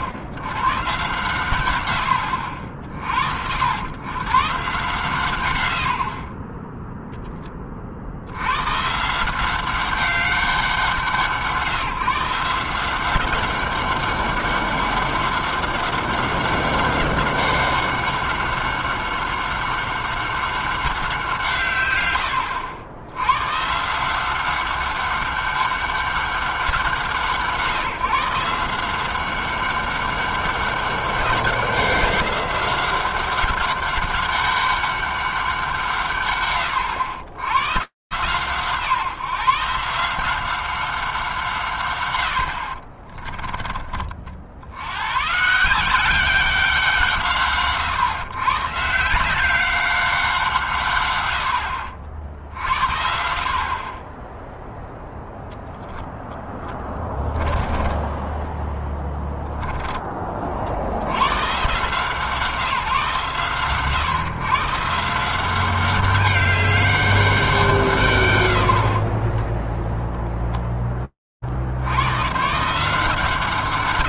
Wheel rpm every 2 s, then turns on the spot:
120, 70, 140, 30, 90, 180, 170, 200, 190, 190, 190, 100, 190, 180, 170, 200, 190, 200, 110, 150, 190, 50, 80, 180, 140, 160, 40, 0, 10, 20, 40, 160, 130, 200, 120, 10, 150.
42-44 56-60